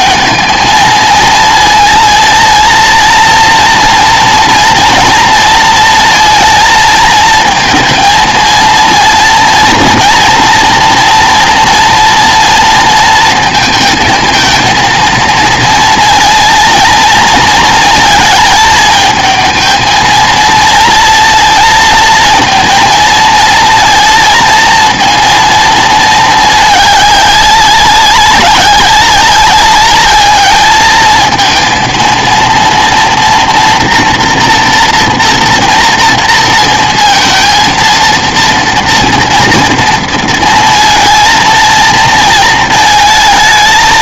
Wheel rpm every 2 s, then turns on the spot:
220, 230, 230, 220, 230, 230, 230, 230, 230, 220, 230, 230, 230, 210, 200, 210, 230, 230, 230, 230, 230, 220.
none